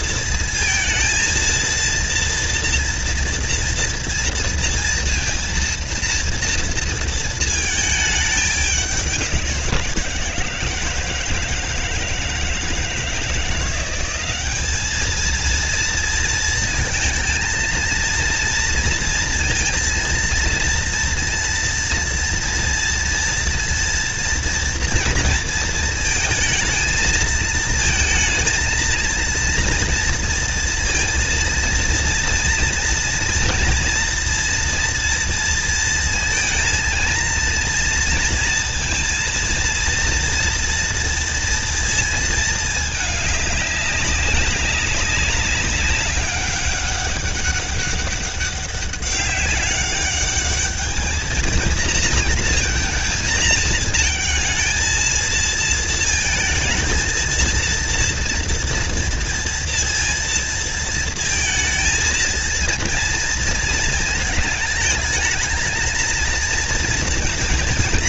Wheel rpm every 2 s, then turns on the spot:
230, 240, 230, 230, 190, 160, 160, 220, 230, 230, 230, 230, 230, 220, 230, 230, 230, 230, 230, 230, 230, 210, 200, 200, 200, 220, 230, 220, 230, 230, 230, 230, 220, 230.
none